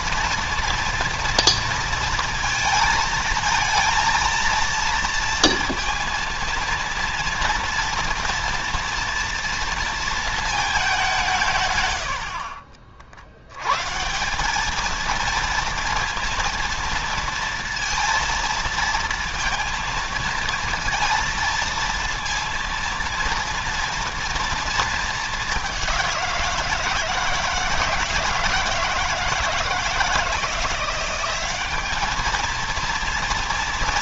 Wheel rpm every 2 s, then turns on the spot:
240, 230, 230, 230, 230, 200, 60, 210, 230, 230, 230, 230, 220, 170, 160, 180, 230.
none